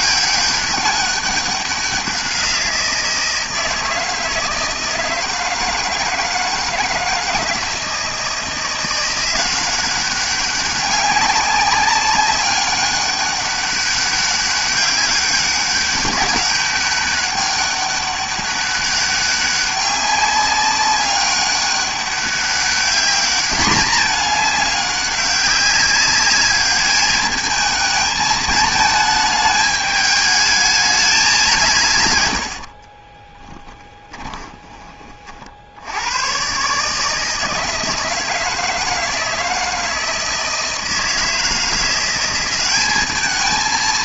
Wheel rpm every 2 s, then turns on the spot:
200, 170, 160, 160, 170, 200, 200, 190, 200, 200, 200, 200, 210, 210, 220, 210, 60, 20, 130, 160, 160, 190.
32-36